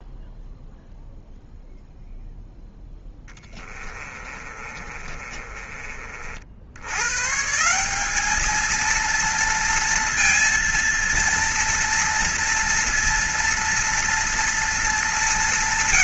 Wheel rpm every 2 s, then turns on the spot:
0, 10, 30, 90, 230, 230, 230, 210.
2-6